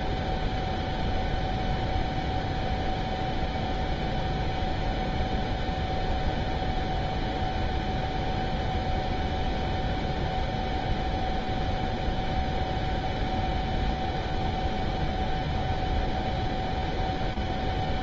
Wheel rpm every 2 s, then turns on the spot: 0, 0, 0, 0, 0, 0, 0, 0, 0.
none